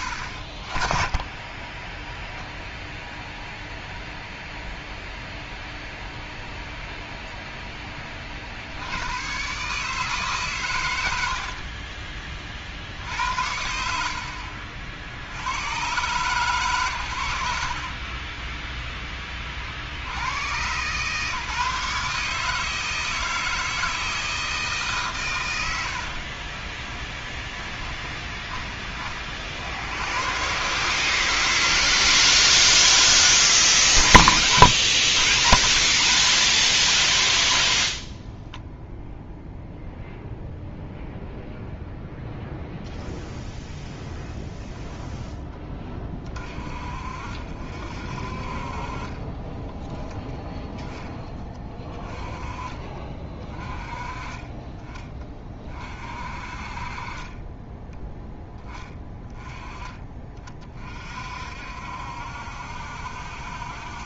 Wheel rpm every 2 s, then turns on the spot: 30, 0, 0, 0, 90, 100, 60, 60, 100, 20, 130, 160, 150, 20, 30, 150, 160, 80, 50, 0, 0, 0, 0, 40, 30, 10, 30, 30, 30, 10, 40, 70.
26-28